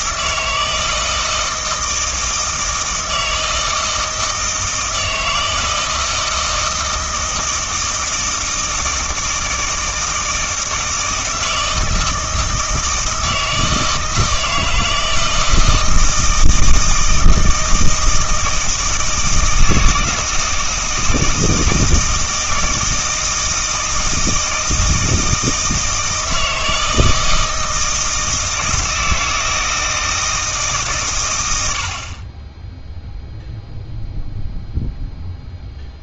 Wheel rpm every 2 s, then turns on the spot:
160, 160, 160, 160, 160, 160, 160, 160, 160, 160, 160, 160, 160, 160, 160, 150, 10, 0.
none